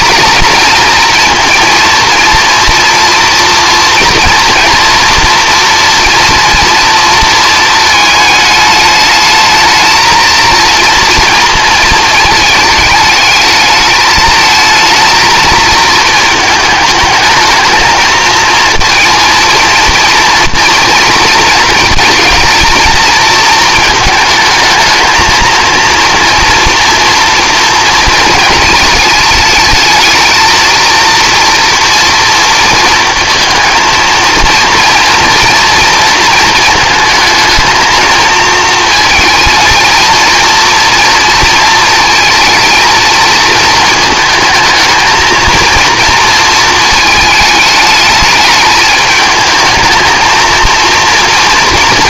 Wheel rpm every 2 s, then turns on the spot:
230, 230, 230, 230, 220, 230, 220, 230, 210, 230, 230, 230, 220, 240, 220, 230, 230, 230, 230, 230, 230, 230, 220, 230, 210, 230.
none